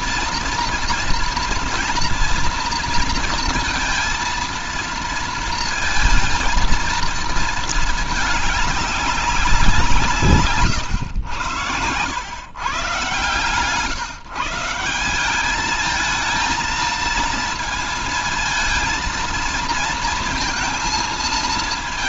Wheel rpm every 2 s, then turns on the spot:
230, 230, 230, 230, 200, 130, 130, 170, 230, 230, 230.
none